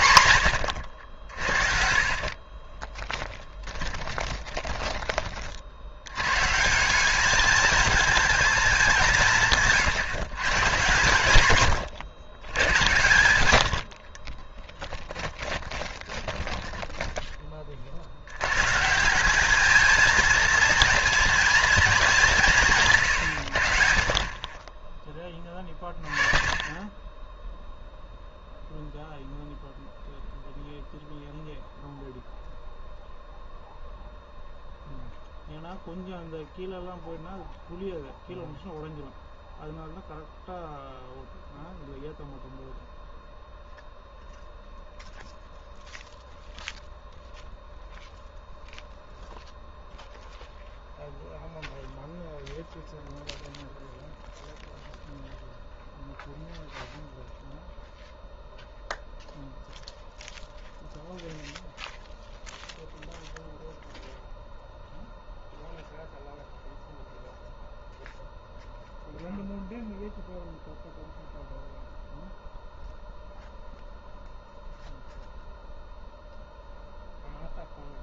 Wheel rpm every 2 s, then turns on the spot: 100, 30, 20, 140, 210, 120, 110, 20, 20, 140, 230, 160, 30, 20, 0, 0, 0, 0, 0, 0, 0, 0, 0, 0, 0, 0, 0, 0, 0, 0, 0, 0, 0, 0, 0, 0, 0, 0, 0.
2-6 14-18